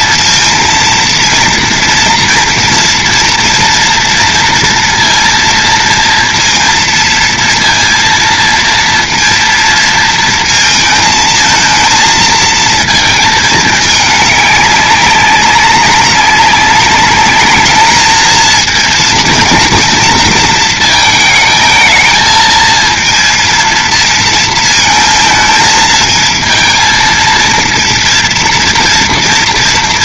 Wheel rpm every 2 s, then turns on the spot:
230, 240, 230, 230, 230, 230, 220, 200, 200, 230, 230, 220, 230, 230, 230.
none